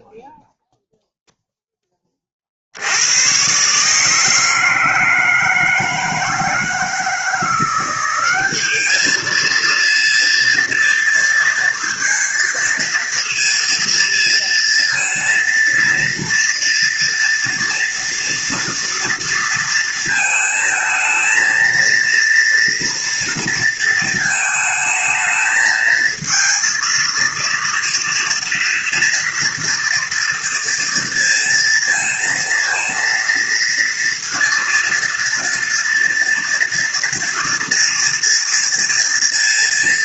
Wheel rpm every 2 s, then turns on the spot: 0, 70, 160, 160, 200, 230, 230, 230, 230, 230, 220, 230, 220, 230, 230, 230, 230, 230, 230, 230.
none